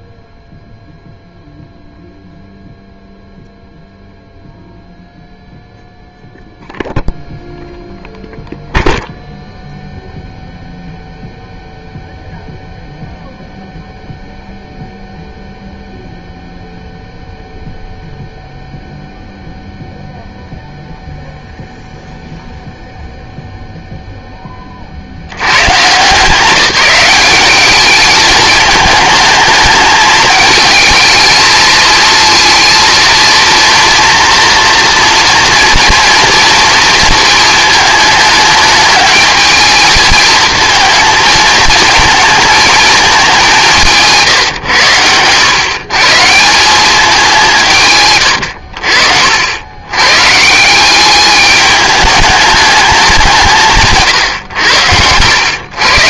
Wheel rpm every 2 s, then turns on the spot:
0, 0, 0, 0, 0, 0, 0, 0, 0, 0, 0, 0, 40, 190, 220, 220, 230, 230, 230, 220, 220, 210, 110, 190, 70, 180, 200, 100.
48-50